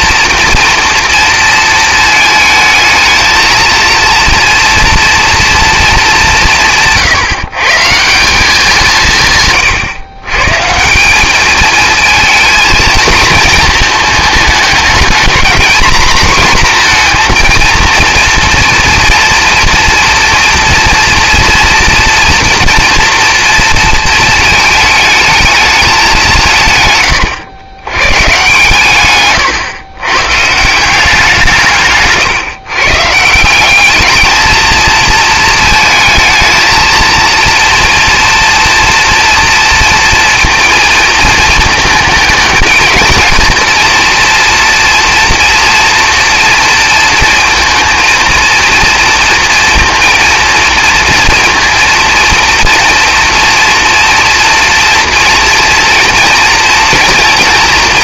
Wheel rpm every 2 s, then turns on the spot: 230, 220, 230, 160, 160, 180, 220, 210, 240, 230, 230, 230, 220, 130, 140, 170, 130, 230, 220, 240, 230, 230, 230, 230, 230, 230, 230, 230, 230.
none